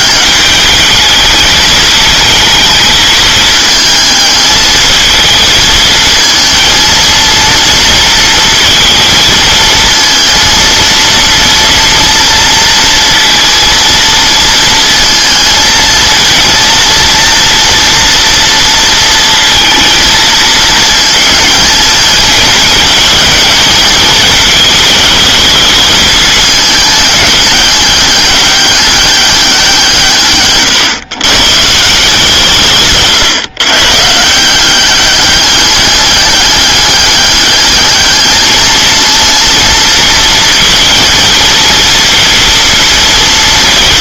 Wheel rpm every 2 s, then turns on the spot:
210, 220, 220, 220, 230, 230, 230, 230, 230, 230, 220, 220, 220, 220, 200, 130, 140, 180, 200, 220, 230, 230.
none